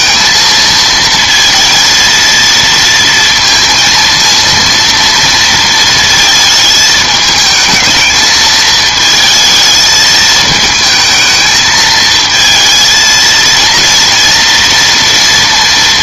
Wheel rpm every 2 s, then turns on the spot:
220, 230, 230, 220, 220, 220, 230, 230.
none